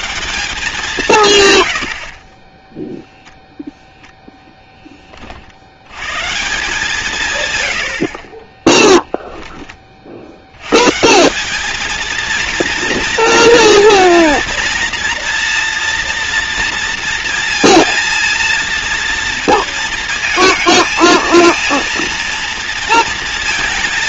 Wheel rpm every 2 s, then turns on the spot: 180, 10, 10, 170, 10, 120, 230, 230, 230, 230, 220, 230.
8-10